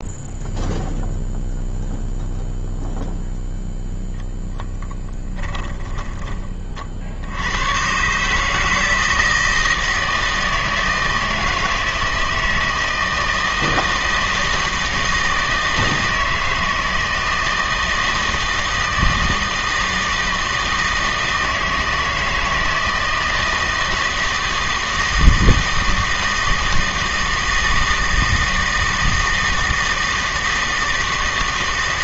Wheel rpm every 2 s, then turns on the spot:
0, 0, 10, 40, 160, 160, 160, 160, 160, 160, 160, 160, 160, 160, 160, 160.
none